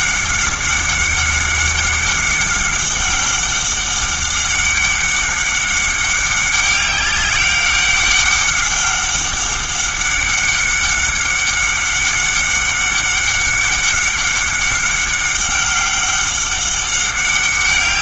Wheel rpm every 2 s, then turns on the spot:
190, 200, 200, 200, 200, 190, 190, 190, 200.
none